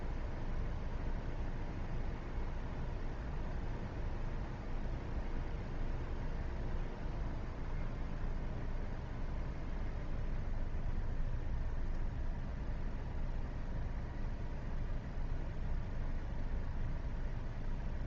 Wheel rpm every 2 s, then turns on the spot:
0, 0, 0, 0, 0, 0, 0, 0, 0.
none